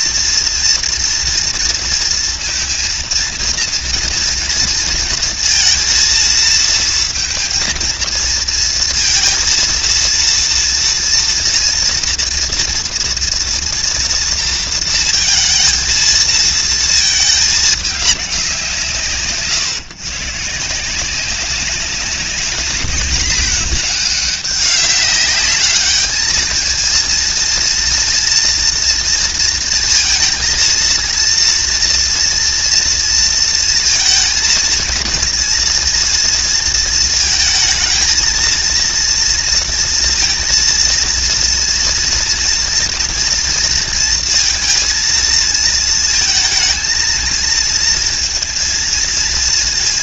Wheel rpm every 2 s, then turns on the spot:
230, 230, 230, 230, 230, 230, 230, 230, 220, 160, 170, 210, 200, 220, 230, 230, 230, 230, 230, 230, 230, 230, 230, 220, 230.
none